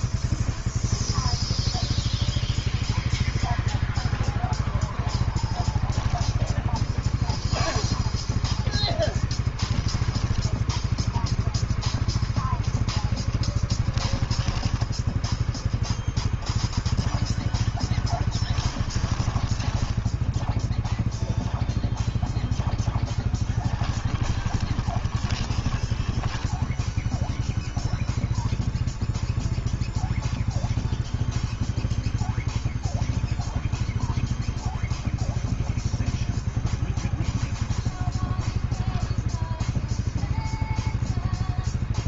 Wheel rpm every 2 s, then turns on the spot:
0, 0, 0, 10, 10, 0, 0, 0, 0, 10, 0, 0, 10, 0, 0, 0, 0, 0, 0, 0, 0.
18-20 24-26